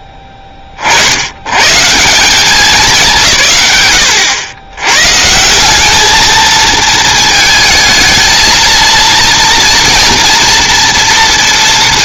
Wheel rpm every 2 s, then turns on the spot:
30, 190, 110, 220, 230, 230.
none